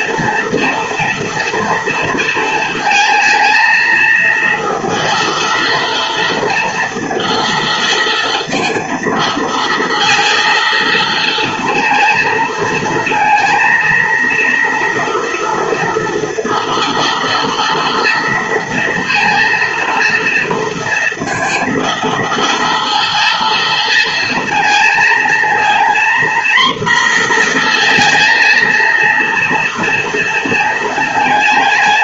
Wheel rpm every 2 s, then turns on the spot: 240, 220, 230, 230, 230, 230, 220, 230, 230, 230, 230, 230, 230, 240, 230, 220.
none